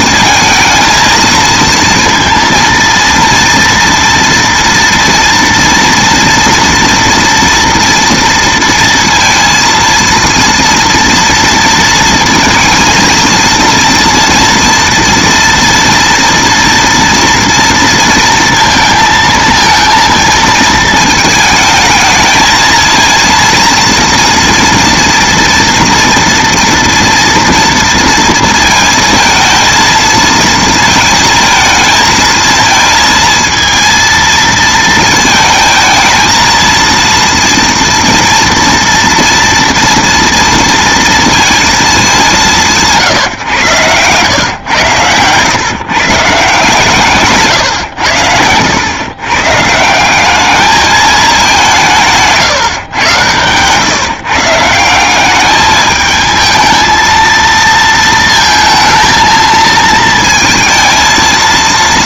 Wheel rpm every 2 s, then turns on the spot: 230, 230, 230, 230, 230, 230, 230, 230, 230, 230, 220, 220, 230, 230, 230, 230, 220, 230, 230, 230, 230, 170, 120, 150, 110, 210, 130, 160, 220, 230, 230.
none